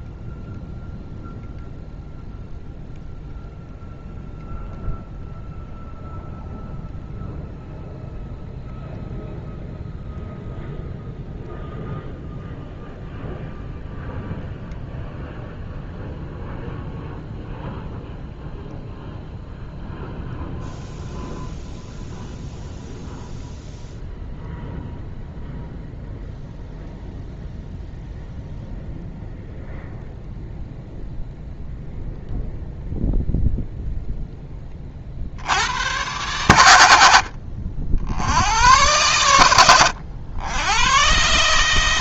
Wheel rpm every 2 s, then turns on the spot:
0, 0, 0, 0, 0, 0, 0, 0, 0, 0, 0, 0, 0, 0, 0, 0, 0, 20, 110, 90, 100.
none